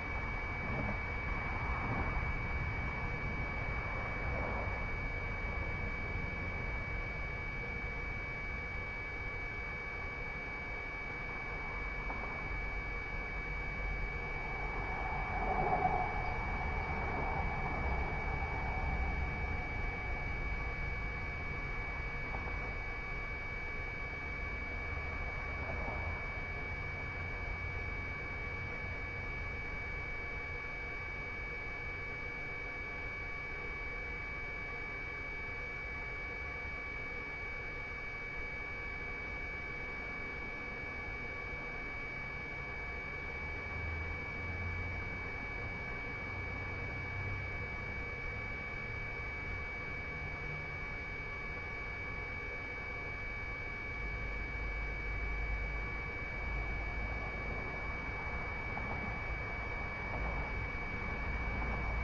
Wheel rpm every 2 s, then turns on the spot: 0, 0, 0, 0, 0, 0, 0, 0, 0, 0, 0, 0, 0, 0, 0, 0, 0, 0, 0, 0, 0, 0, 0, 0, 0, 0, 0, 0, 0, 0, 0.
none